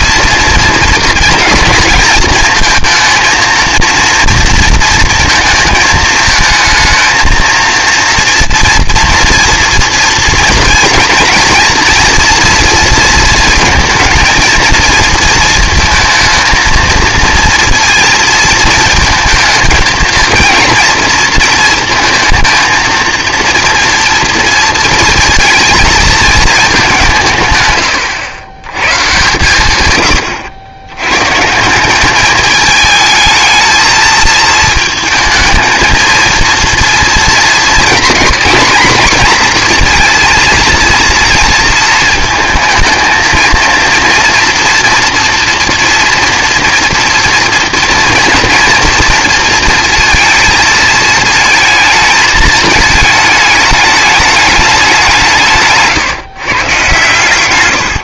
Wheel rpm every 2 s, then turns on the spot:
220, 230, 220, 230, 240, 230, 220, 230, 230, 230, 230, 230, 220, 130, 120, 170, 220, 220, 220, 230, 230, 230, 230, 230, 230, 220, 220, 160, 130.
none